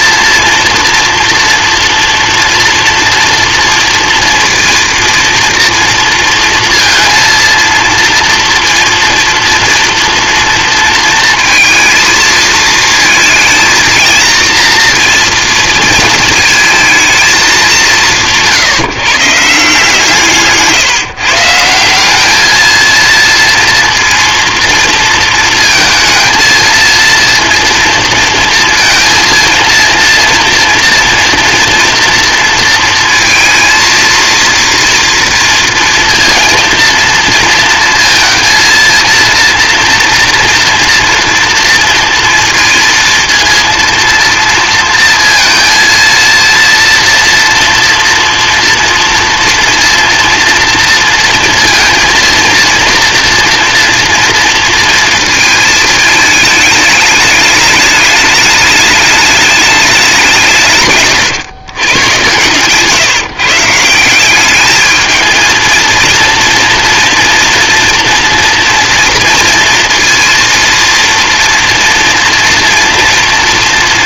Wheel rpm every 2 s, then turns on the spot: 230, 240, 230, 230, 230, 230, 220, 230, 220, 150, 160, 230, 230, 230, 230, 230, 230, 230, 230, 230, 240, 230, 230, 240, 230, 230, 230, 230, 210, 210, 130, 140, 220, 230, 230, 230, 240.
60-62